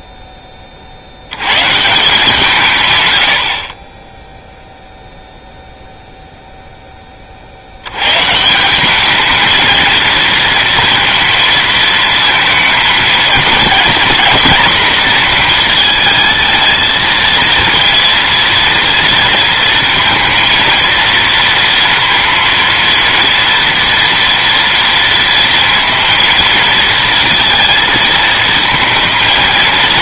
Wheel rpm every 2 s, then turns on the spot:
30, 140, 0, 0, 170, 230, 230, 230, 230, 230, 230, 230, 230, 230, 220.
none